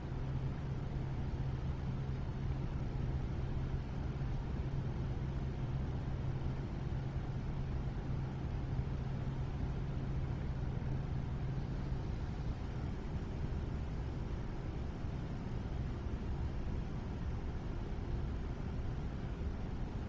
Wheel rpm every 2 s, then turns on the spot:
0, 0, 0, 0, 0, 0, 0, 0, 0, 0.
none